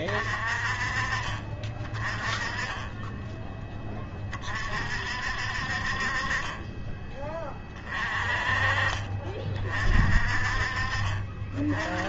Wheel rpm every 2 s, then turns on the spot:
40, 10, 50, 20, 40, 40.
none